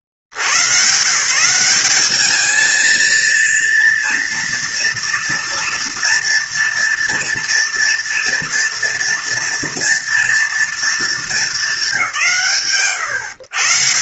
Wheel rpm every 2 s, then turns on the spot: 70, 220, 230, 230, 230, 230, 160.
none